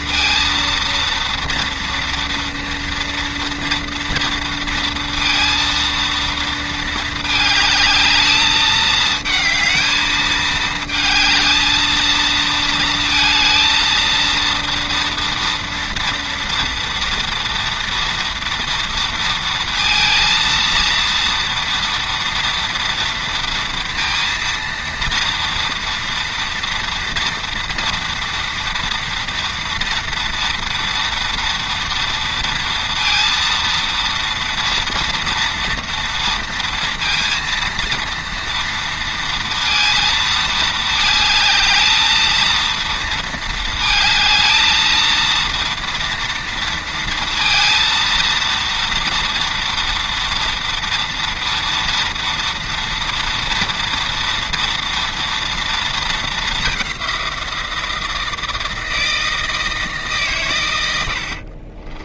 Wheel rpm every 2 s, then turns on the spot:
230, 230, 230, 220, 220, 220, 230, 230, 230, 230, 230, 230, 230, 230, 230, 240, 230, 230, 230, 230, 220, 230, 220, 230, 230, 240, 230, 230, 200, 160, 110.
none